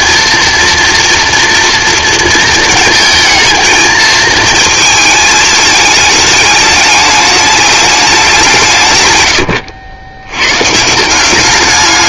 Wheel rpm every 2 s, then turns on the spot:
230, 230, 220, 210, 150, 140.
none